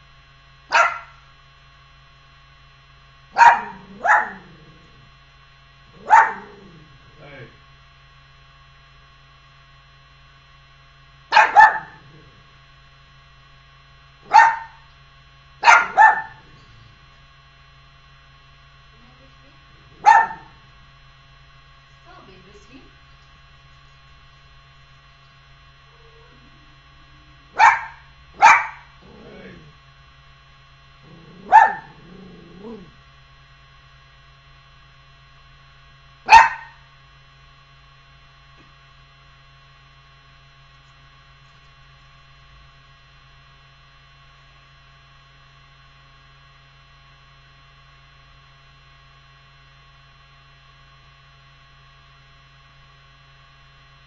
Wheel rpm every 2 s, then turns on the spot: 0, 0, 0, 0, 0, 0, 0, 0, 0, 0, 0, 0, 0, 0, 0, 0, 0, 0, 0, 0, 0, 0, 0, 0, 0, 0, 0.
none